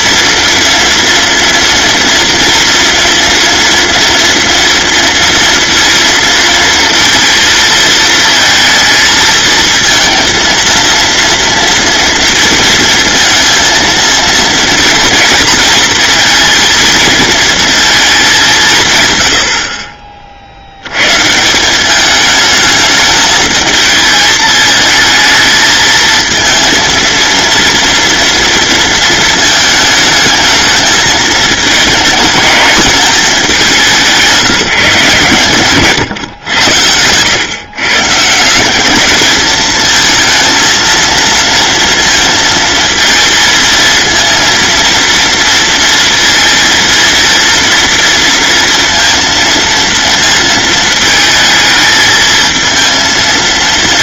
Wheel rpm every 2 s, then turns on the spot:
230, 230, 230, 230, 220, 230, 230, 230, 230, 150, 90, 220, 220, 230, 230, 220, 210, 150, 100, 200, 230, 230, 230, 230, 230, 220, 230.
none